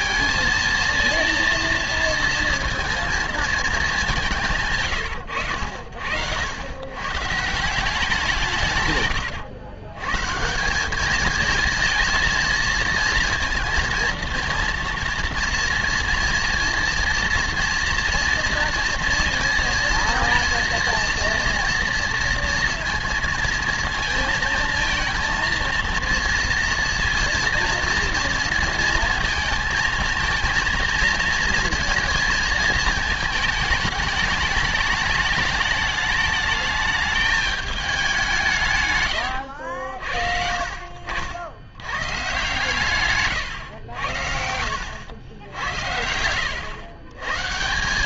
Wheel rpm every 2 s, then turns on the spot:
230, 230, 150, 90, 140, 180, 230, 230, 230, 230, 230, 230, 230, 230, 230, 220, 220, 210, 210, 150, 50, 140, 80, 110.
none